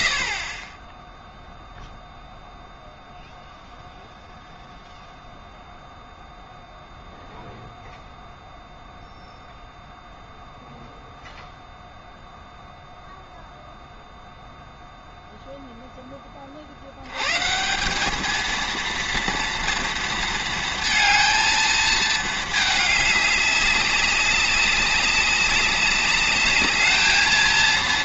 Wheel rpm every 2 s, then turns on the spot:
20, 0, 0, 0, 0, 0, 0, 0, 60, 230, 230, 220, 200, 210.
none